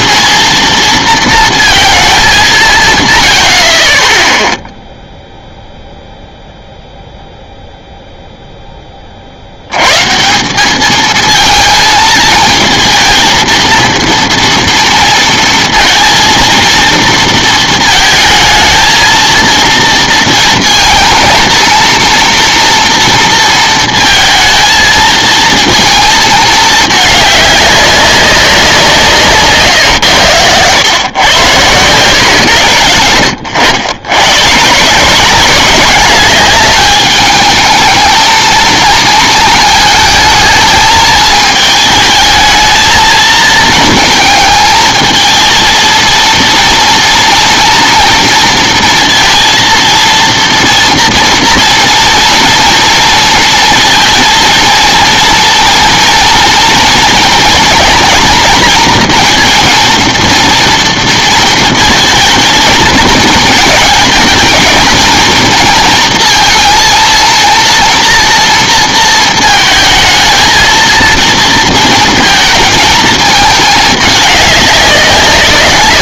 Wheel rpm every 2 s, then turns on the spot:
230, 170, 0, 0, 10, 190, 220, 230, 230, 220, 230, 230, 220, 220, 190, 110, 120, 150, 200, 220, 220, 220, 220, 230, 230, 230, 230, 230, 230, 230, 230, 220, 230, 230, 230, 230, 220, 200.
none